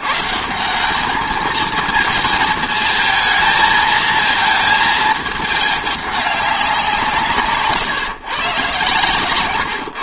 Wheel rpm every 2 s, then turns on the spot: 180, 220, 220, 190, 140.
none